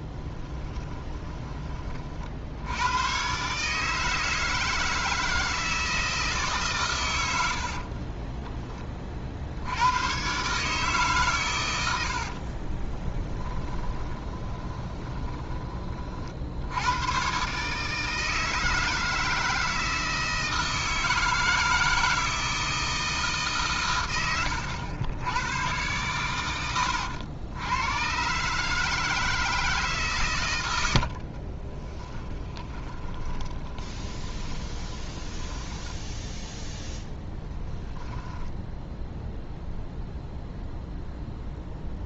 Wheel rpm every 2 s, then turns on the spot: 20, 90, 160, 130, 30, 140, 30, 20, 80, 160, 160, 160, 90, 90, 150, 90, 20, 20, 0, 0, 0.
0-2 12-16 30-36